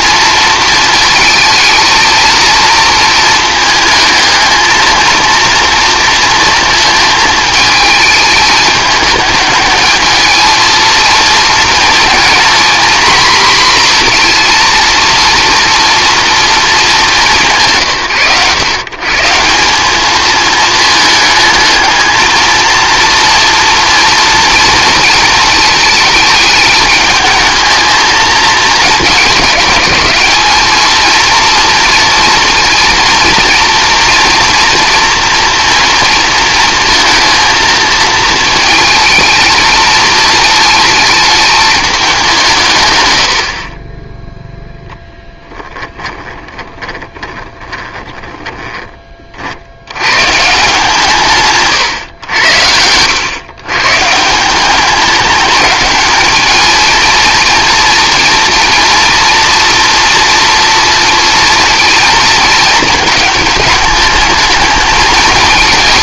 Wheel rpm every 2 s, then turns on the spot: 230, 230, 220, 220, 210, 230, 230, 230, 220, 140, 220, 230, 230, 220, 220, 230, 230, 230, 230, 220, 220, 130, 0, 20, 20, 150, 100, 190, 220, 240, 230, 220, 220.
46-48